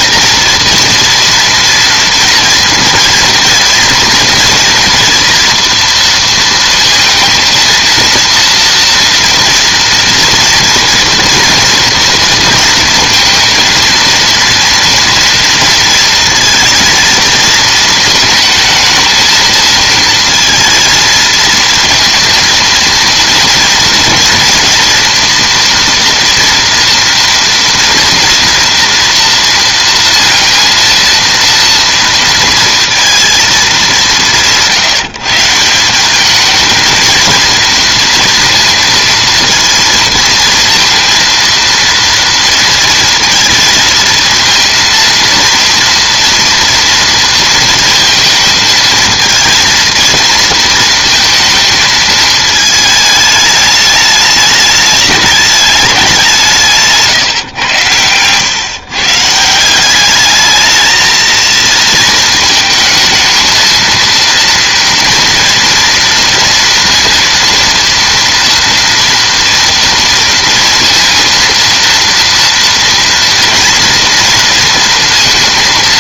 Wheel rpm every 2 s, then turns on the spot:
230, 230, 240, 230, 230, 230, 230, 230, 230, 220, 230, 240, 230, 240, 230, 230, 230, 160, 220, 230, 230, 230, 230, 240, 220, 230, 220, 210, 170, 130, 220, 220, 230, 230, 230, 230, 230, 230.
none